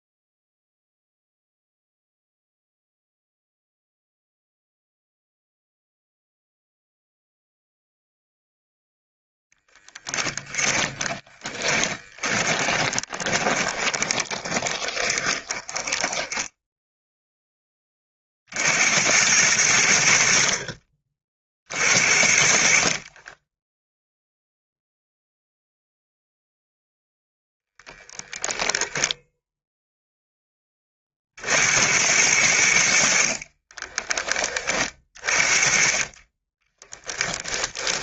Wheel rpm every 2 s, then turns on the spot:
0, 0, 0, 0, 0, 20, 10, 20, 10, 80, 40, 40, 0, 0, 10, 30, 70, 30, 10.
10-16 36-38